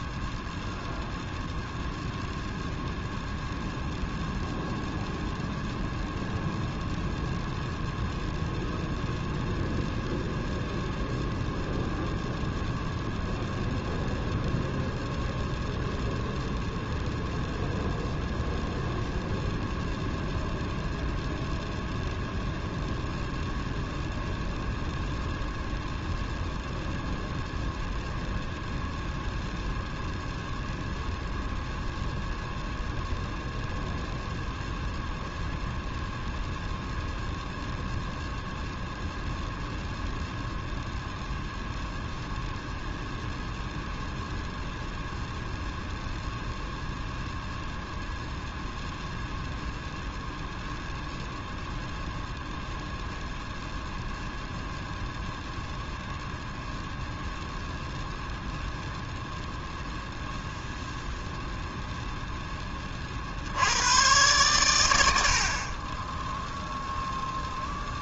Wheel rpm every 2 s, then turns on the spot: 0, 0, 0, 0, 0, 0, 0, 0, 0, 0, 0, 0, 0, 0, 0, 0, 0, 0, 0, 0, 0, 0, 0, 0, 0, 0, 0, 0, 0, 0, 0, 10, 110, 0.
none